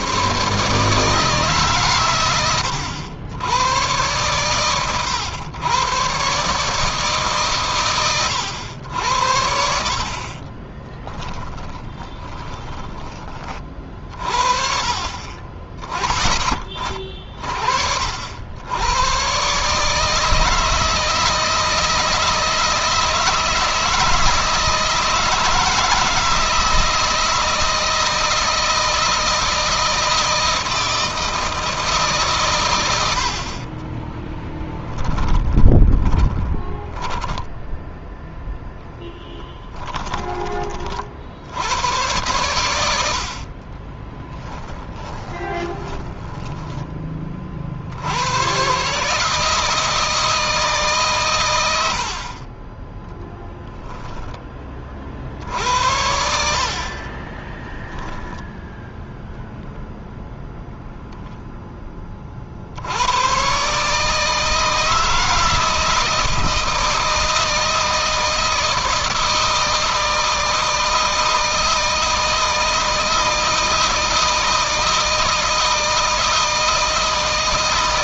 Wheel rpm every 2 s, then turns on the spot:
140, 90, 100, 140, 90, 30, 20, 40, 30, 100, 160, 160, 160, 160, 160, 160, 100, 10, 10, 10, 40, 70, 30, 20, 130, 140, 20, 40, 40, 10, 0, 70, 160, 160, 160, 160, 160, 160, 160.
10-14 34-38 44-46 52-54 56-58